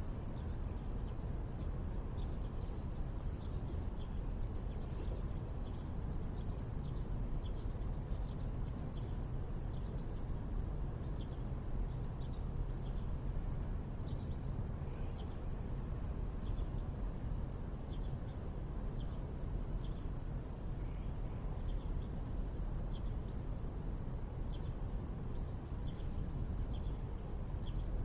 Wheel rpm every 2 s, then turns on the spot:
0, 0, 0, 0, 0, 0, 0, 0, 0, 0, 0, 0, 0, 0.
none